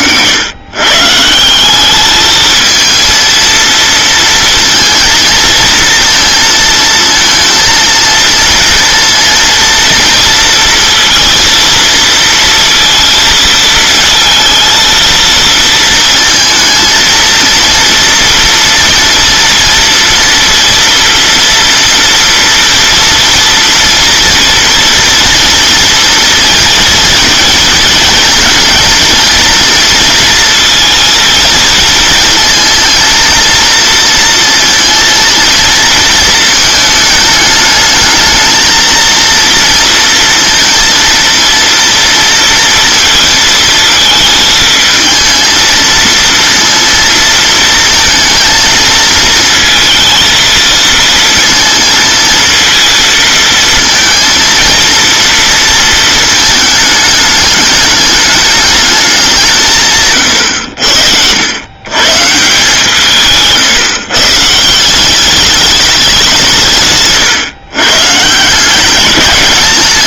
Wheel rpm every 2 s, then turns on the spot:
120, 220, 230, 230, 230, 230, 230, 230, 230, 230, 230, 230, 230, 230, 230, 230, 230, 230, 220, 220, 230, 230, 220, 230, 220, 230, 230, 230, 220, 210, 100, 160, 150, 160, 180.
60-62